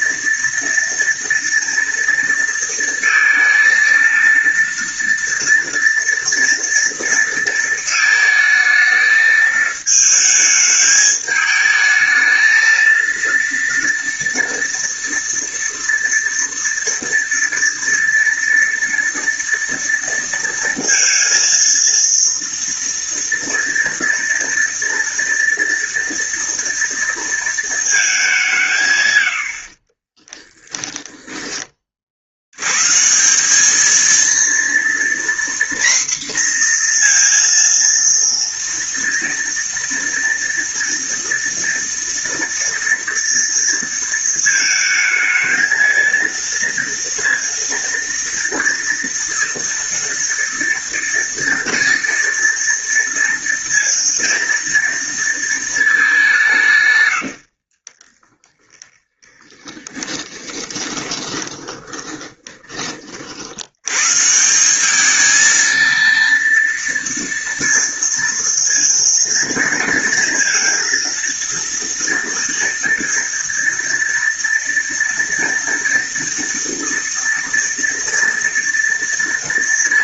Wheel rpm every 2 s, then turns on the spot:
230, 230, 230, 230, 220, 220, 220, 230, 230, 230, 230, 230, 230, 230, 190, 10, 90, 230, 240, 230, 230, 230, 220, 230, 230, 230, 230, 230, 170, 20, 10, 20, 160, 230, 230, 230, 230, 230, 240, 230.
30-32 58-62